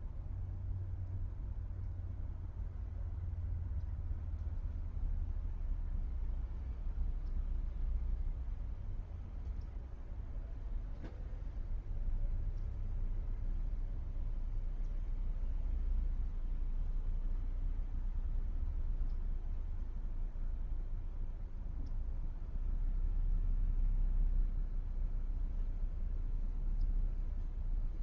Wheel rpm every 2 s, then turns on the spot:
0, 0, 0, 0, 0, 0, 0, 0, 0, 0, 0, 0, 0, 0.
none